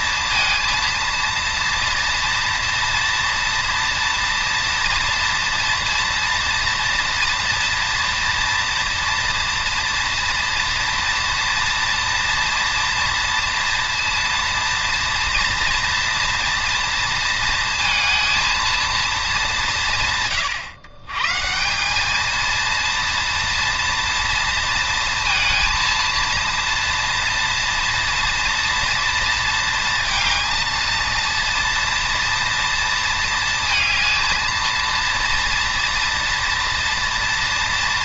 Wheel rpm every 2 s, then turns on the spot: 230, 230, 230, 230, 230, 230, 230, 230, 230, 230, 140, 230, 230, 230, 230, 220, 230, 230, 230.
none